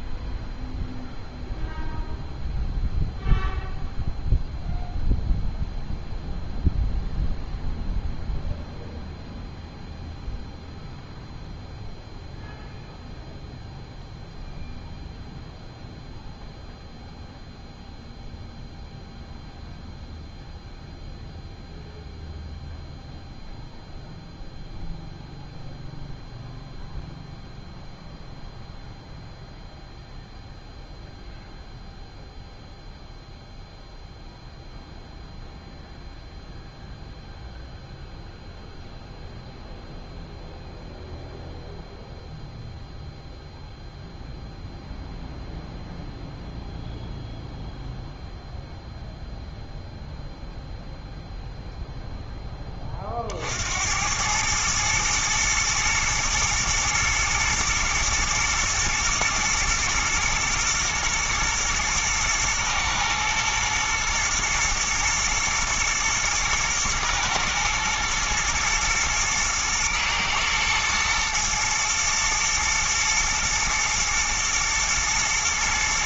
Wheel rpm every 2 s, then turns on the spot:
0, 0, 0, 0, 0, 0, 0, 0, 0, 0, 0, 0, 0, 0, 0, 0, 0, 0, 0, 0, 0, 0, 0, 0, 0, 0, 20, 110, 110, 120, 120, 110, 110, 120, 110, 110, 110, 110.
none